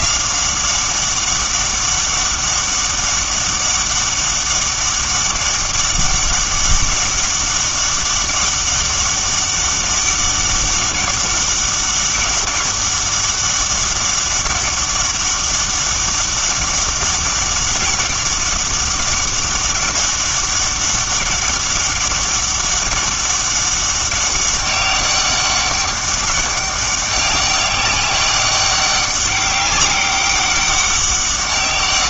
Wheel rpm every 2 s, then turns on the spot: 190, 200, 200, 200, 200, 200, 200, 200, 200, 200, 200, 200, 200, 200, 200, 200.
none